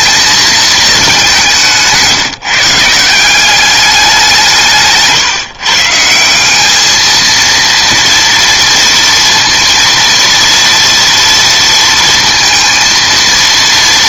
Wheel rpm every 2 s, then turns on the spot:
220, 150, 160, 200, 230, 230, 230.
none